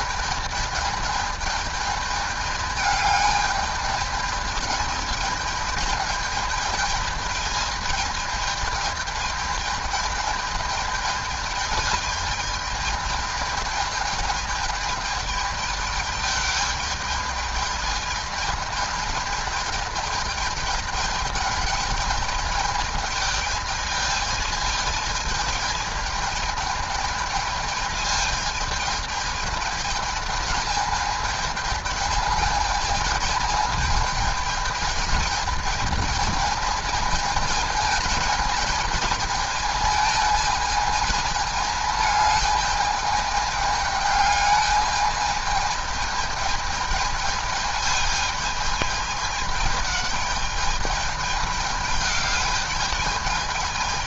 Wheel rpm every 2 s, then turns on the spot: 210, 210, 210, 220, 220, 210, 210, 210, 210, 220, 210, 220, 220, 220, 210, 220, 220, 220, 220, 220, 220, 210, 210, 220, 210, 210, 210.
none